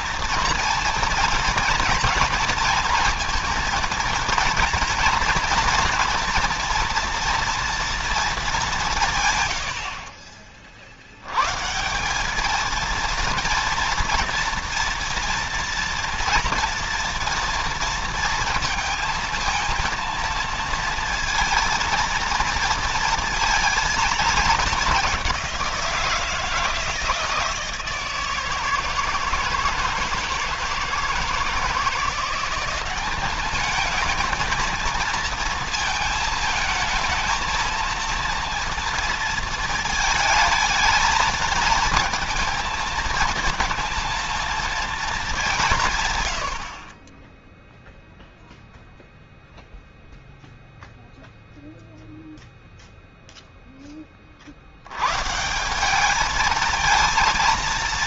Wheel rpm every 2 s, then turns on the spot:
230, 230, 230, 240, 180, 40, 220, 240, 230, 230, 230, 230, 200, 160, 160, 160, 190, 220, 220, 230, 220, 220, 230, 50, 0, 0, 0, 70, 220.
none